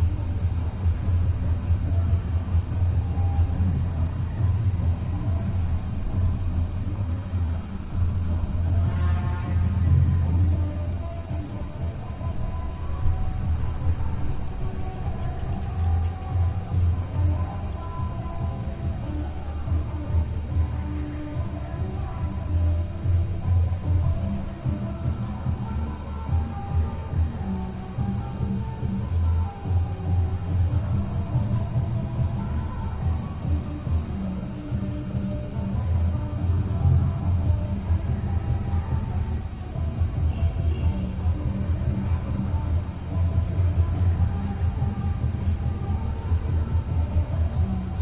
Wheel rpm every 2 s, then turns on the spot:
0, 0, 0, 0, 0, 0, 0, 0, 0, 0, 0, 0, 0, 0, 0, 0, 0, 0, 0, 0, 0, 0, 0, 0.
none